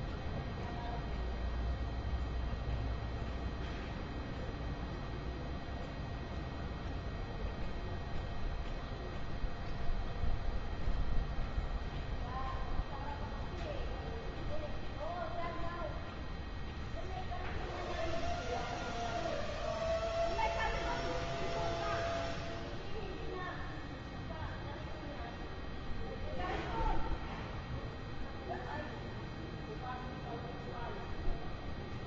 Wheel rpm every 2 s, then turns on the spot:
0, 0, 0, 0, 0, 0, 0, 0, 0, 0, 0, 0, 0, 0, 0, 0.
none